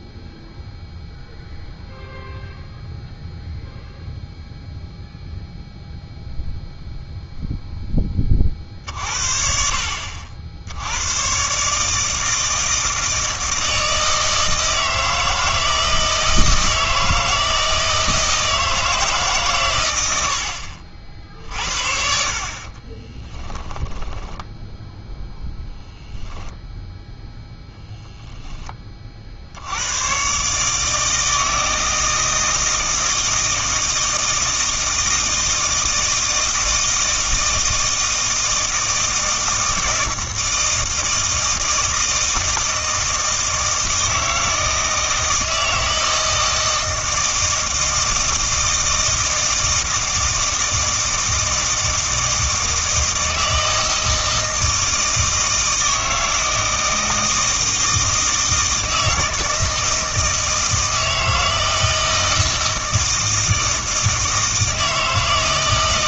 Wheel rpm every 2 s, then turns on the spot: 0, 0, 0, 0, 40, 90, 160, 160, 160, 160, 60, 30, 0, 0, 20, 150, 160, 160, 160, 160, 160, 160, 160, 160, 160, 160, 160, 160, 160, 160, 160, 160, 160.
22-24